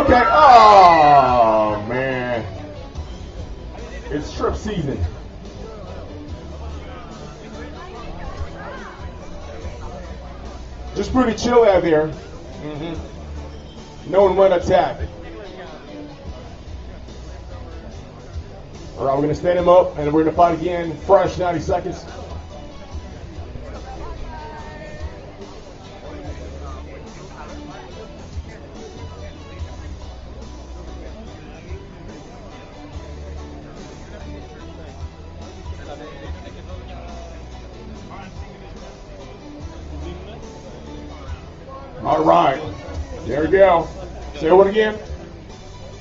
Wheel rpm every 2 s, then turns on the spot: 0, 0, 0, 0, 0, 0, 0, 0, 0, 0, 0, 0, 0, 0, 0, 0, 0, 0, 0, 0, 0, 0, 0.
none